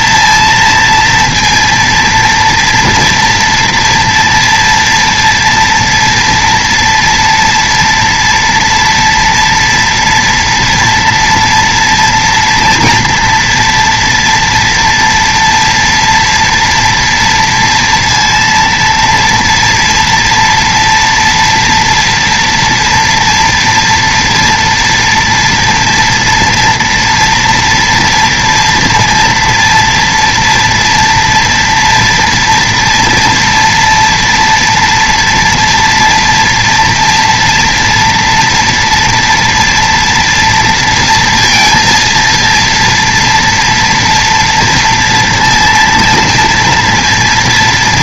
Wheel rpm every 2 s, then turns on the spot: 230, 230, 230, 240, 230, 230, 240, 230, 230, 230, 230, 230, 230, 230, 230, 230, 230, 230, 230, 240, 230, 230, 230, 230.
none